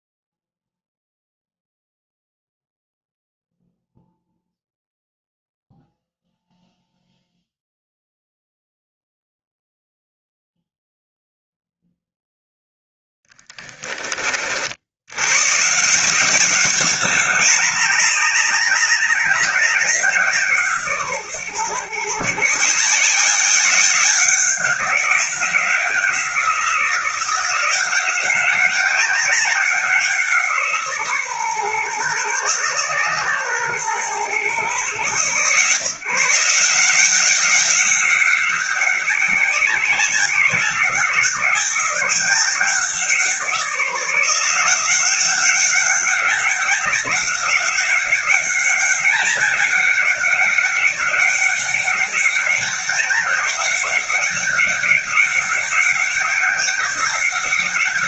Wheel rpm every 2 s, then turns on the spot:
0, 0, 0, 0, 0, 0, 0, 90, 200, 190, 140, 160, 190, 180, 190, 150, 130, 120, 180, 180, 190, 180, 190, 190, 200, 200, 190, 190, 190.
none